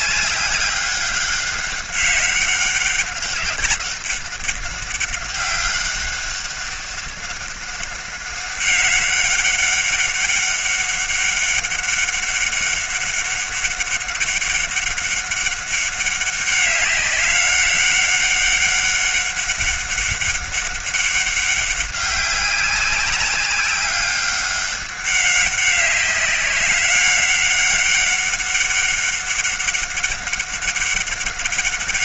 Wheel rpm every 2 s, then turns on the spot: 200, 200, 200, 190, 200, 200, 200, 200, 200, 200, 200, 200, 200, 200, 200, 200.
none